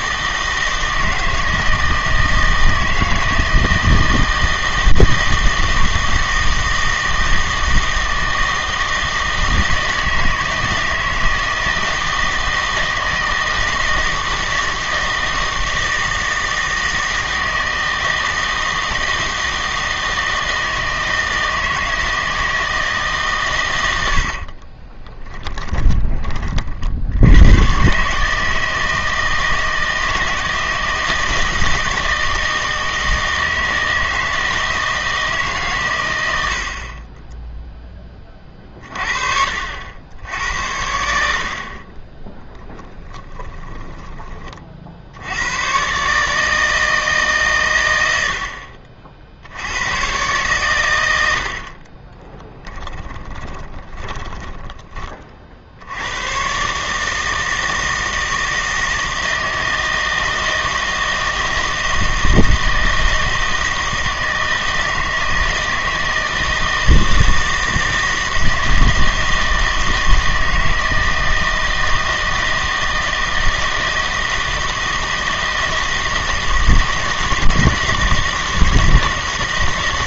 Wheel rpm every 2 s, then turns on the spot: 160, 160, 160, 160, 160, 160, 160, 160, 160, 160, 160, 160, 40, 40, 160, 160, 160, 160, 60, 30, 90, 10, 40, 150, 60, 120, 10, 10, 130, 160, 160, 160, 160, 160, 160, 160, 160, 160, 160, 160.
24-26 42-44 52-54